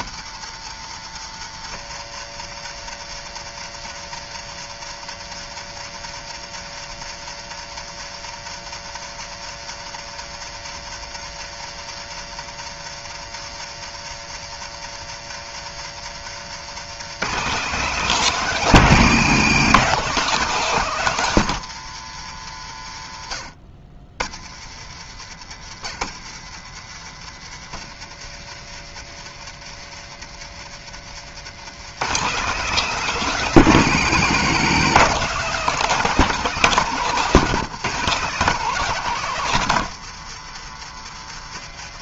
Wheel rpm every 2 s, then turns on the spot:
120, 120, 120, 120, 120, 120, 120, 120, 180, 180, 160, 70, 100, 120, 120, 140, 190, 180, 180, 150, 120.
30-32